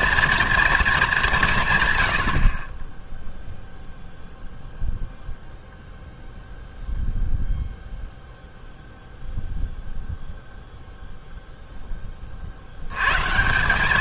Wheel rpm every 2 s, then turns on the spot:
240, 50, 0, 0, 0, 0, 70.
none